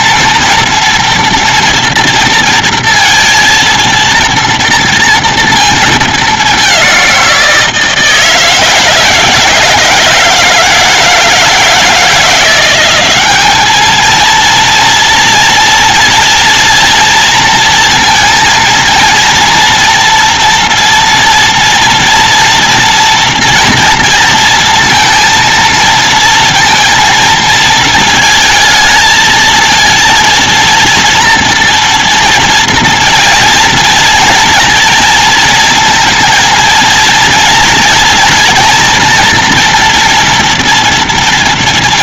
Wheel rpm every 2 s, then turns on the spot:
230, 230, 230, 210, 160, 160, 170, 220, 230, 230, 230, 230, 230, 230, 220, 230, 230, 240, 230, 230, 230.
none